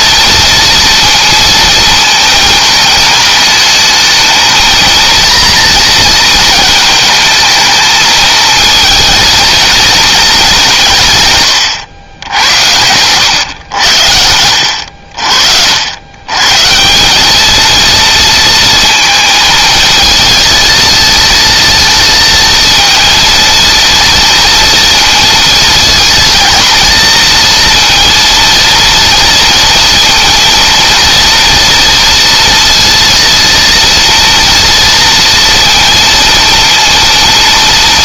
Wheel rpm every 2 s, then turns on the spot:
230, 220, 230, 230, 230, 150, 100, 60, 190, 230, 220, 230, 230, 230, 230, 230, 230, 230, 230.
none